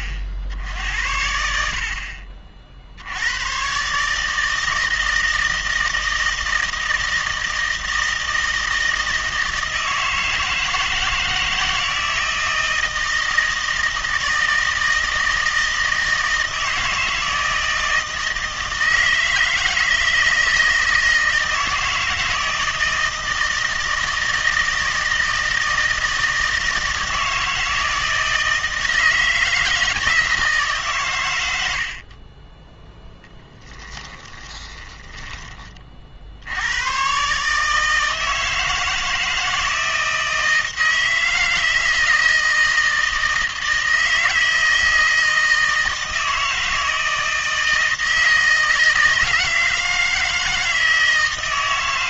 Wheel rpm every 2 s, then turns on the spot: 60, 60, 160, 160, 160, 160, 160, 160, 160, 160, 160, 160, 160, 160, 160, 150, 10, 20, 90, 160, 160, 160, 160, 160, 160, 160.
34-36